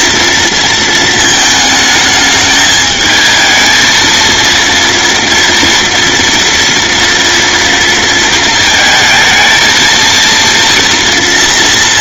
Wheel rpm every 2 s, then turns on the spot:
220, 220, 230, 240, 220, 230.
none